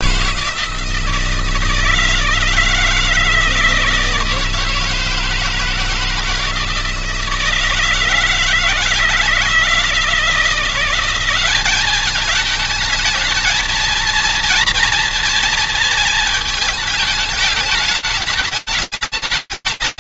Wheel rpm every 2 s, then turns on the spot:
160, 160, 160, 160, 160, 160, 200, 230, 220, 210.
none